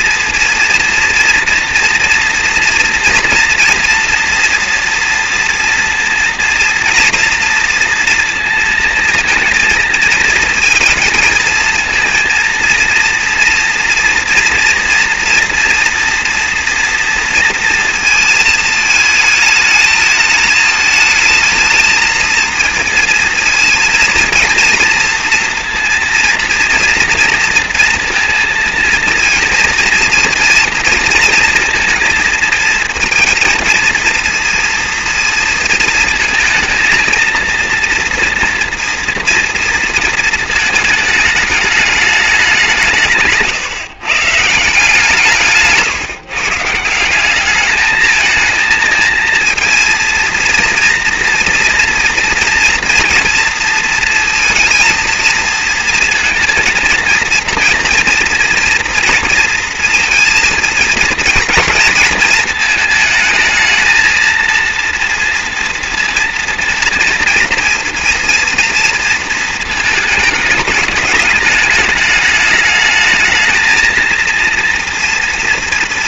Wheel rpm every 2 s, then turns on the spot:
230, 230, 230, 240, 230, 220, 230, 230, 230, 220, 210, 230, 230, 230, 230, 230, 230, 230, 230, 230, 220, 190, 160, 150, 220, 230, 230, 230, 220, 230, 230, 220, 230, 230, 230, 220, 210, 230.
none